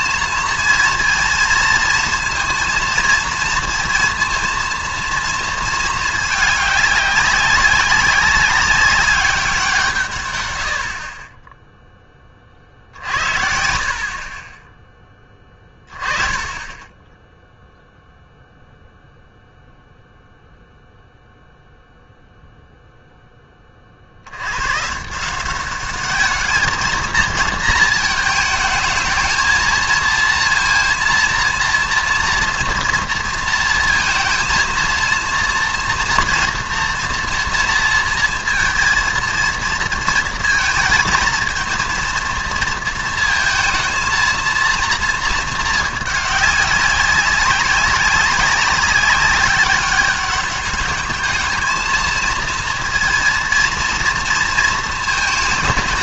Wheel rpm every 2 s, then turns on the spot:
230, 230, 230, 210, 200, 80, 40, 20, 10, 0, 0, 0, 110, 220, 220, 230, 240, 230, 230, 230, 220, 230, 230, 200, 190, 200, 230, 230.
none